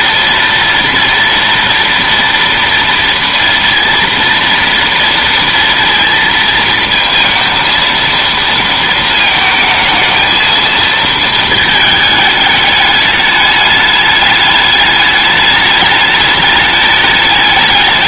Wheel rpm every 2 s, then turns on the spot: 230, 230, 230, 230, 230, 220, 210, 210, 210.
none